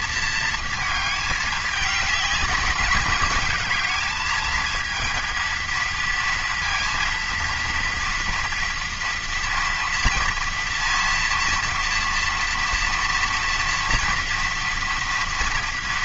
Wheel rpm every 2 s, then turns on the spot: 220, 210, 230, 230, 230, 230, 230, 230.
none